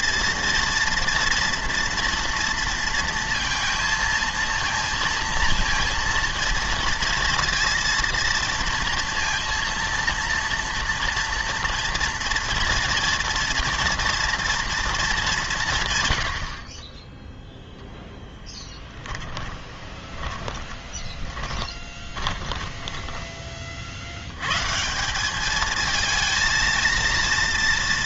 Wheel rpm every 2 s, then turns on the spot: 230, 230, 230, 230, 230, 230, 240, 240, 40, 10, 20, 20, 130, 230.
18-24